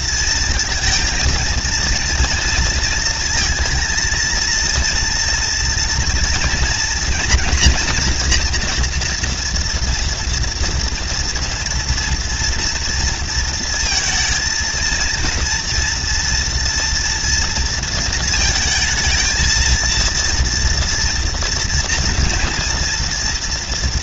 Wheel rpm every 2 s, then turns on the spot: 230, 230, 230, 230, 240, 230, 240, 220, 230, 230, 230, 230.
none